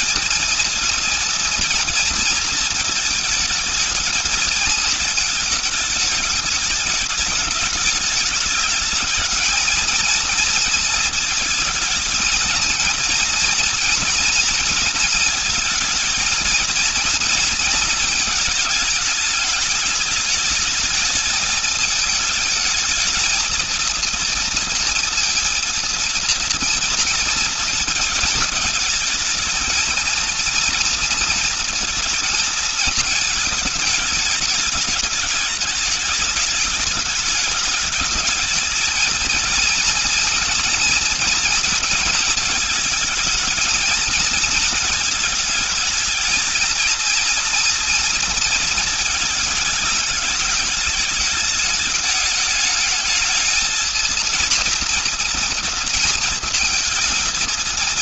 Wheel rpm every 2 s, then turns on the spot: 230, 220, 220, 210, 220, 230, 230, 230, 220, 210, 220, 220, 230, 230, 220, 230, 220, 210, 210, 220, 230, 220, 230, 230, 230, 210, 220, 240, 220.
none